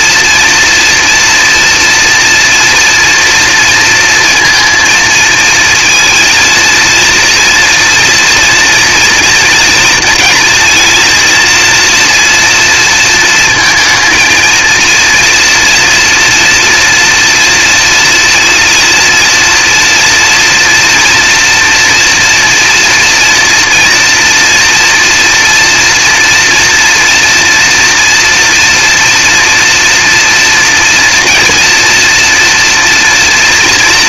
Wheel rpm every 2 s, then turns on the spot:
230, 230, 230, 230, 230, 230, 230, 230, 230, 240, 230, 230, 230, 240, 230, 230, 240.
none